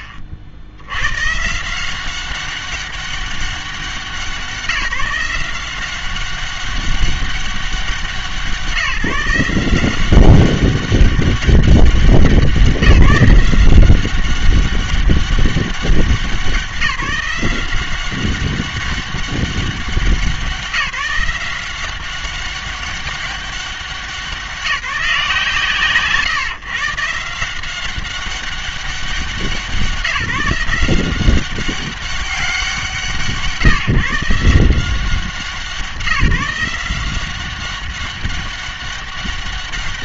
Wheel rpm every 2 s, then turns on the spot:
70, 190, 170, 190, 170, 190, 190, 190, 180, 190, 180, 200, 180, 140, 200, 170, 180, 170, 170, 190.
none